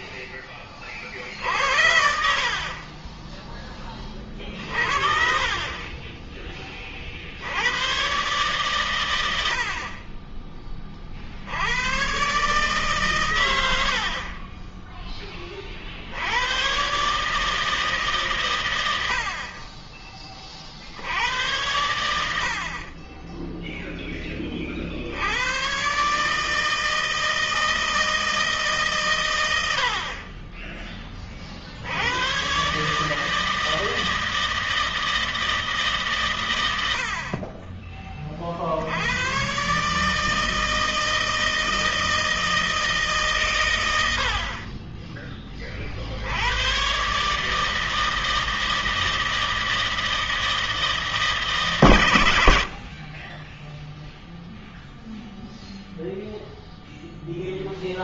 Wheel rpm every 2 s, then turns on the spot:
10, 60, 30, 20, 120, 30, 130, 40, 70, 140, 30, 80, 20, 140, 160, 40, 100, 160, 140, 30, 150, 160, 100, 50, 160, 160, 120, 0, 0.
none